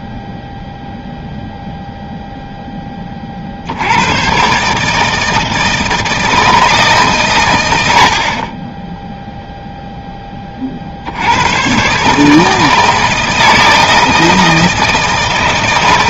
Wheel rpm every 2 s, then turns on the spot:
0, 0, 130, 160, 30, 30, 160, 160.
none